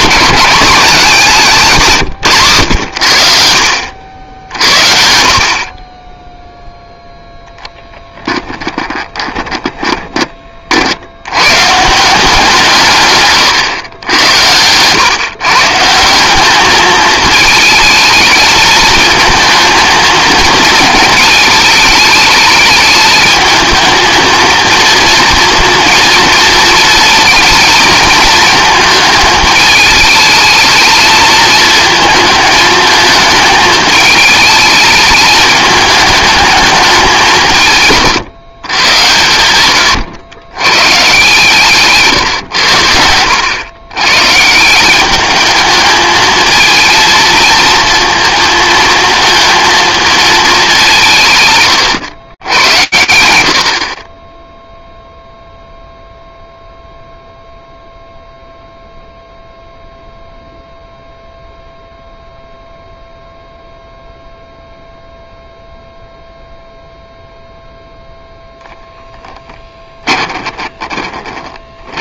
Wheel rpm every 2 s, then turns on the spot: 210, 120, 70, 0, 10, 40, 170, 110, 200, 220, 220, 210, 230, 230, 220, 220, 220, 220, 210, 140, 110, 120, 150, 220, 230, 210, 90, 0, 0, 0, 0, 0, 0, 0, 10, 30.
8-10 68-72